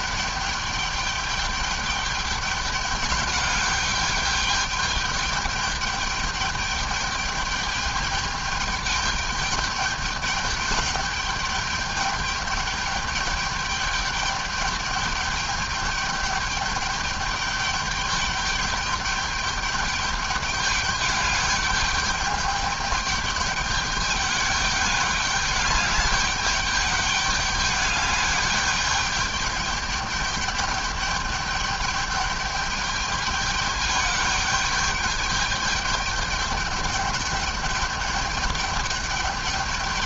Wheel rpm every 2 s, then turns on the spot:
210, 200, 210, 210, 210, 210, 210, 210, 210, 210, 200, 210, 210, 200, 200, 210, 200, 210, 210, 210.
none